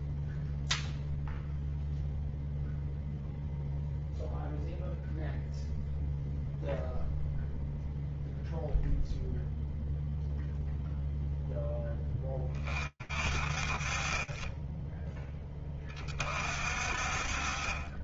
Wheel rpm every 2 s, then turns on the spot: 0, 0, 0, 0, 0, 20, 40, 40, 10.
none